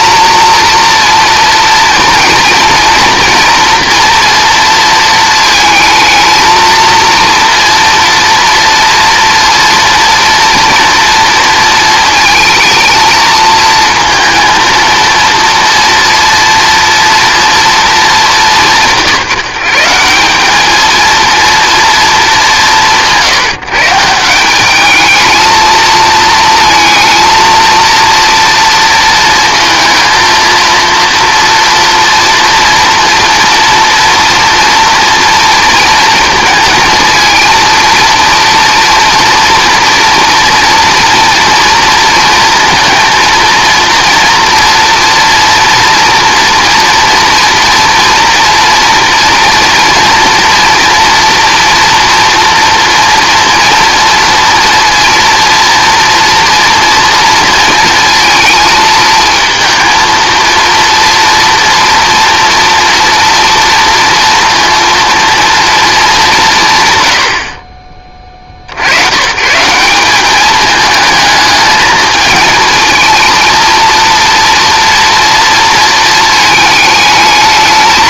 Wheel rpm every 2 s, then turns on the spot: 230, 240, 230, 230, 230, 230, 230, 230, 240, 180, 210, 190, 190, 230, 240, 230, 240, 230, 220, 230, 230, 230, 230, 230, 230, 230, 240, 230, 240, 220, 230, 230, 230, 150, 70, 210, 220, 230, 220.
none